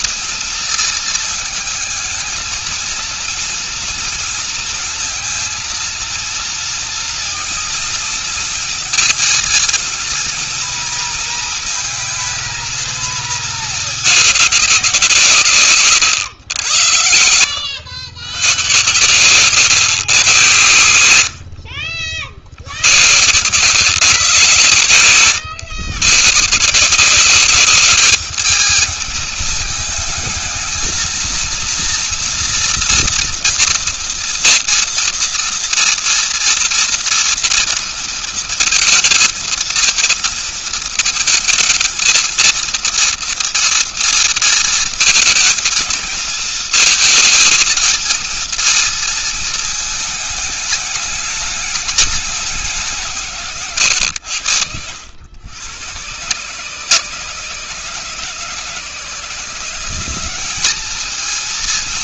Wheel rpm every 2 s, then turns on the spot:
230, 230, 230, 230, 230, 230, 230, 180, 90, 120, 90, 100, 130, 170, 210, 220, 240, 230, 230, 230, 230, 230, 230, 230, 230, 210, 180, 90, 140, 150, 210.
none